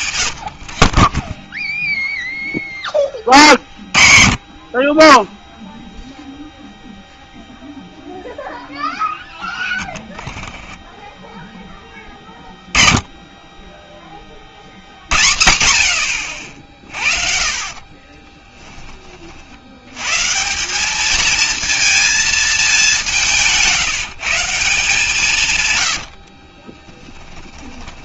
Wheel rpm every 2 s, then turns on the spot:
60, 0, 50, 0, 0, 0, 20, 70, 60, 10, 180, 210, 160, 40.
0-2 16-18 26-28